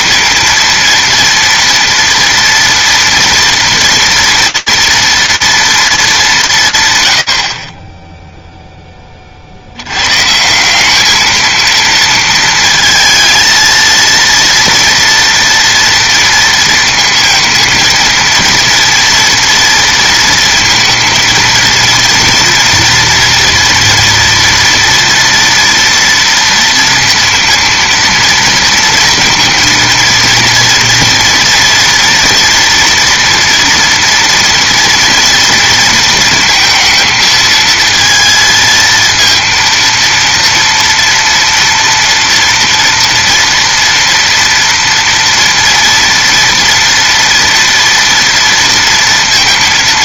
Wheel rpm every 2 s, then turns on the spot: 230, 230, 230, 180, 10, 190, 230, 230, 230, 230, 230, 230, 230, 230, 230, 230, 230, 230, 220, 220, 230, 230, 230, 230, 230.
none